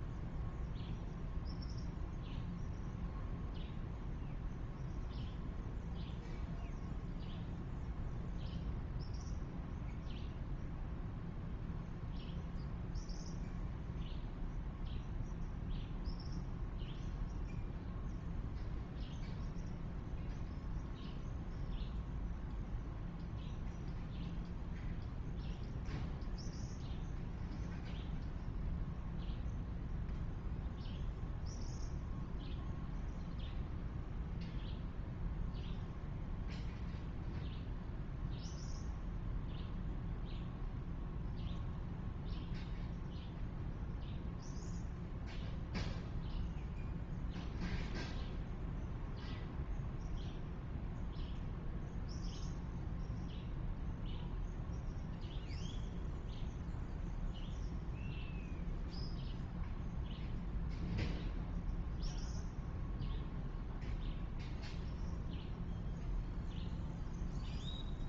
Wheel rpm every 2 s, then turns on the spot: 0, 0, 0, 0, 0, 0, 0, 0, 0, 0, 0, 0, 0, 0, 0, 0, 0, 0, 0, 0, 0, 0, 0, 0, 0, 0, 0, 0, 0, 0, 0, 0, 0, 0.
none